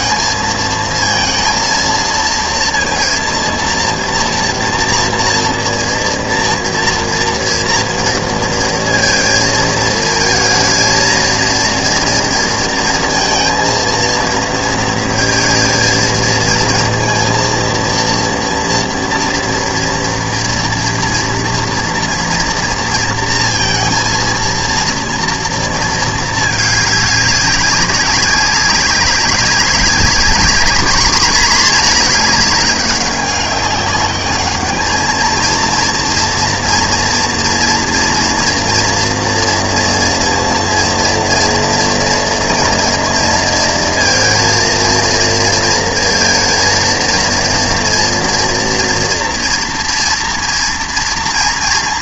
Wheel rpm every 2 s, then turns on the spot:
230, 230, 230, 230, 230, 220, 230, 230, 220, 230, 230, 240, 230, 210, 190, 210, 210, 210, 240, 230, 240, 240, 230, 230, 230, 230.
none